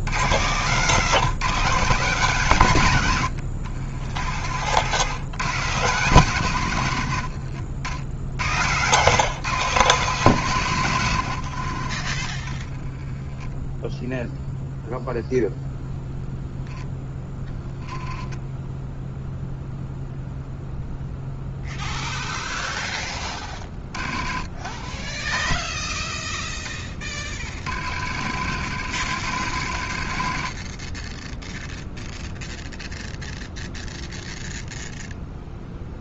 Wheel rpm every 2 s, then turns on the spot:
100, 150, 70, 140, 100, 140, 20, 0, 10, 0, 0, 10, 30, 40, 90, 20, 0, 0.
26-32